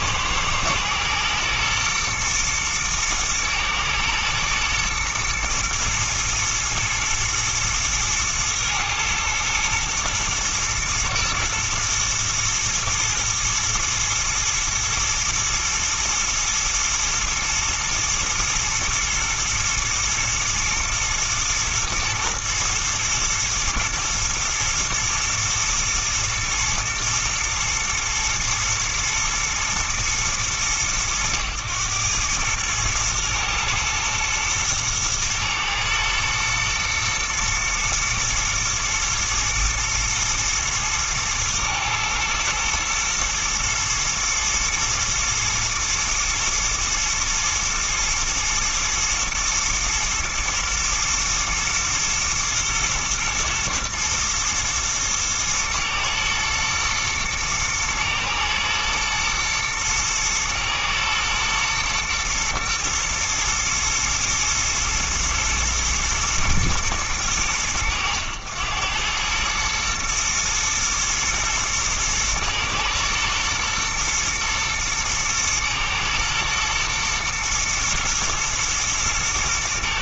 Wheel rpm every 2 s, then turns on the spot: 120, 120, 110, 120, 110, 120, 120, 110, 110, 110, 120, 110, 110, 110, 110, 100, 110, 110, 110, 110, 120, 110, 120, 110, 110, 120, 110, 120, 110, 110, 110, 110, 120, 110, 100, 110, 110, 110, 120, 120.
none